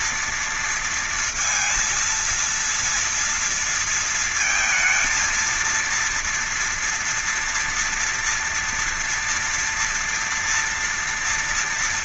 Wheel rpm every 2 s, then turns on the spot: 230, 230, 220, 230, 230, 240.
none